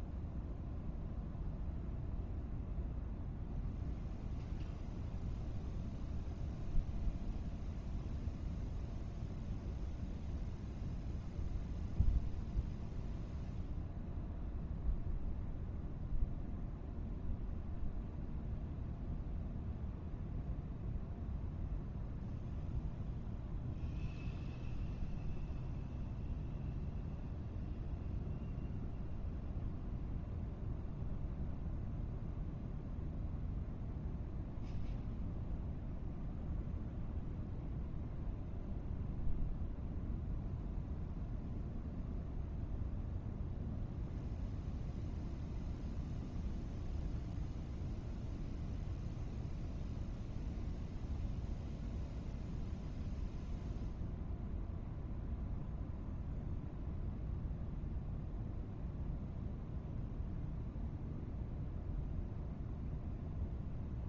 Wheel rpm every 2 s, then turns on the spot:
0, 0, 0, 0, 0, 0, 0, 0, 0, 0, 0, 0, 0, 0, 0, 0, 0, 0, 0, 0, 0, 0, 0, 0, 0, 0, 0, 0, 0, 0, 0, 0.
none